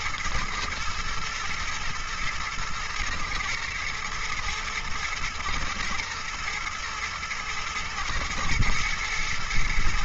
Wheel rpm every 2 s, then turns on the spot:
110, 110, 110, 120, 120.
none